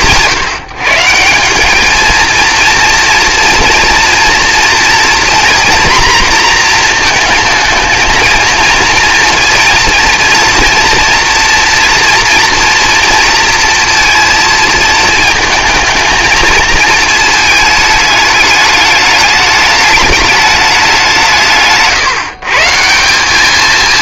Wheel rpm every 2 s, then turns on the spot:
160, 230, 240, 230, 230, 230, 230, 220, 220, 210, 200, 190.
none